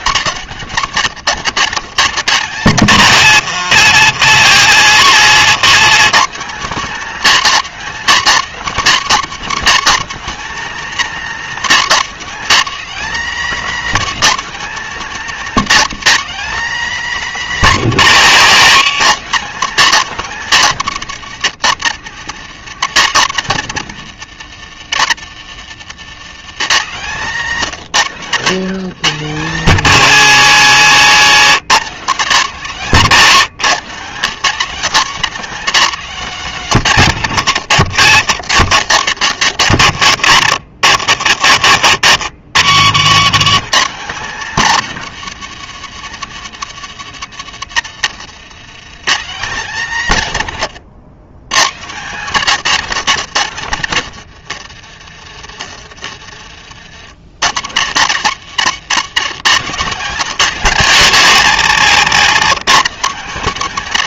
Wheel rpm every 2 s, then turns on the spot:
110, 150, 170, 240, 220, 230, 240, 250, 250, 180, 200, 180, 120, 160, 150, 120, 170, 180, 170, 100, 80, 160, 220, 170, 110, 120, 150, 50, 40, 120, 180, 180.
26-28 38-40 50-52 58-60